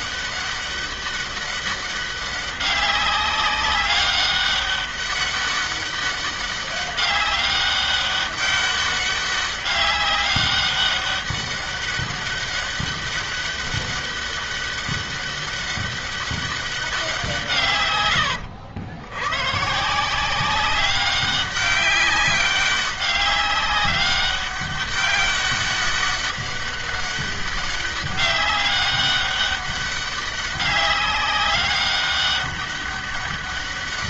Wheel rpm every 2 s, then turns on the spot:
200, 190, 200, 200, 200, 200, 200, 200, 200, 100, 180, 200, 200, 200, 200, 200, 200.
none